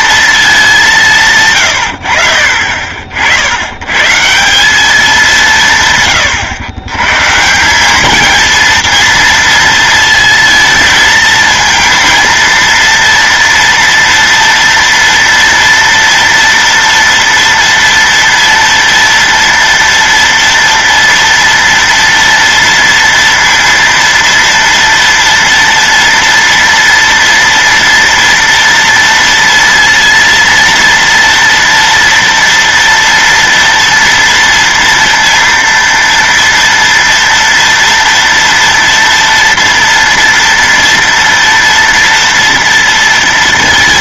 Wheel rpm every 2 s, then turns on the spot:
220, 50, 180, 110, 220, 230, 230, 230, 230, 230, 230, 230, 230, 230, 230, 230, 230, 230, 230, 240, 230, 230.
none